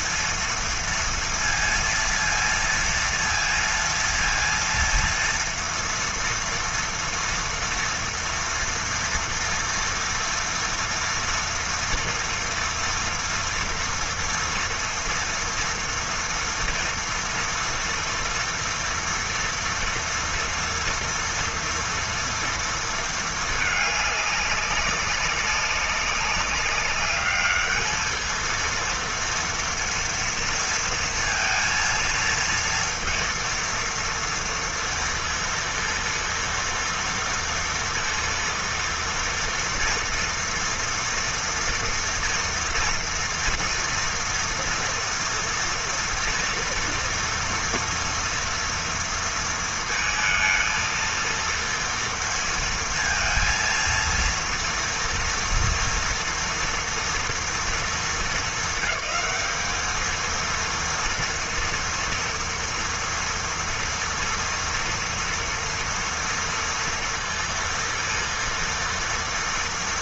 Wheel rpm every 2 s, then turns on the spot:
230, 230, 230, 230, 230, 230, 230, 230, 230, 240, 230, 230, 200, 200, 230, 230, 230, 230, 230, 230, 240, 230, 230, 230, 230, 220, 230, 230, 230, 220, 230, 230, 230, 230, 230.
none